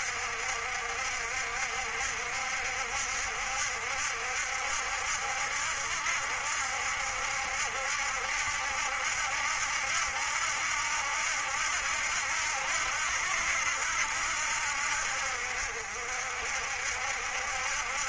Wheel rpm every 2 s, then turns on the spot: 60, 60, 70, 70, 70, 80, 80, 70, 60.
none